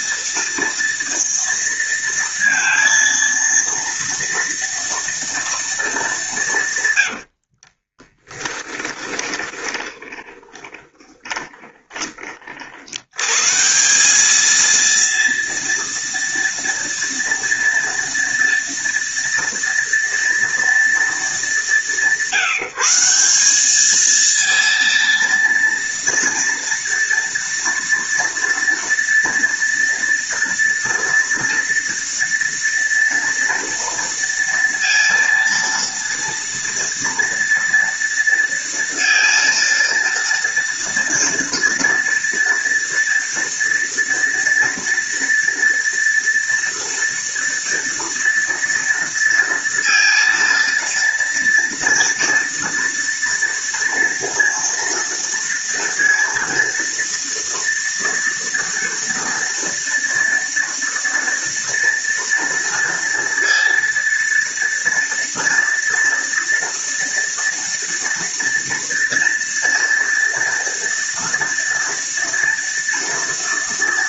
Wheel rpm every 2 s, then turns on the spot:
230, 230, 230, 90, 20, 20, 100, 230, 230, 230, 220, 180, 230, 230, 240, 230, 230, 230, 230, 230, 230, 230, 230, 230, 230, 230, 230, 230, 230, 230, 230, 230, 230, 230, 240, 230, 230.
6-12